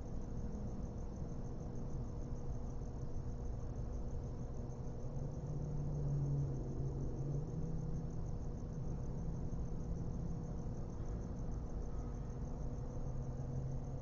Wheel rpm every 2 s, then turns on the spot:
0, 0, 0, 0, 0, 0, 0.
none